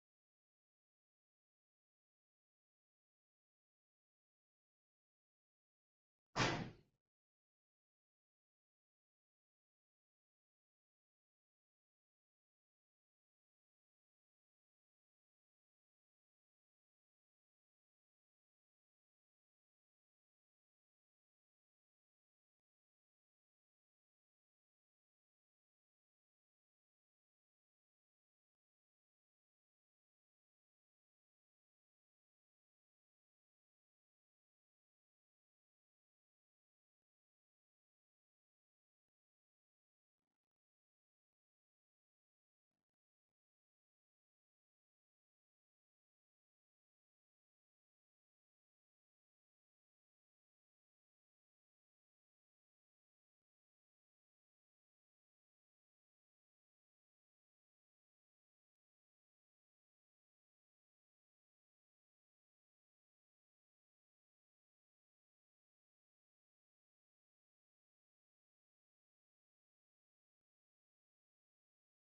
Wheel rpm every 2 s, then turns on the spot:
0, 0, 0, 0, 0, 0, 0, 0, 0, 0, 0, 0, 0, 0, 0, 0, 0, 0, 0, 0, 0, 0, 0, 0, 0, 0, 0, 0, 0, 0, 0, 0, 0, 0, 0, 0.
none